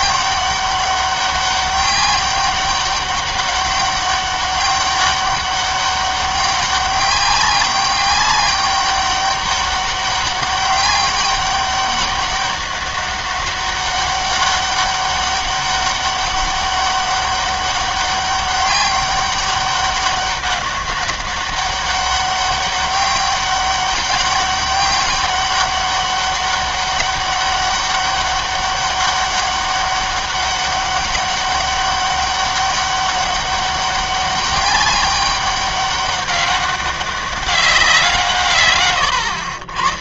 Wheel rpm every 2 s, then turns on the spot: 200, 200, 200, 200, 200, 200, 200, 200, 200, 200, 200, 200, 200, 200, 200, 200, 200, 200, 200, 120.
none